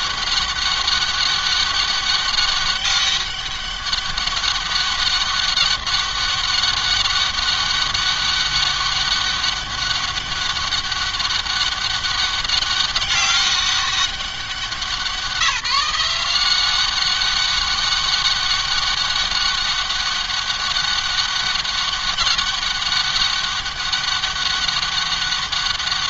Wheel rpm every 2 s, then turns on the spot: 200, 200, 200, 200, 200, 200, 200, 190, 190, 200, 200, 200, 200.
none